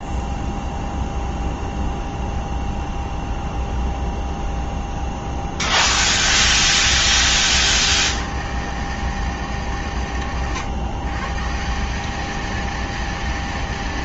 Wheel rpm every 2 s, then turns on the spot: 0, 0, 0, 70, 110, 110, 230.
6-8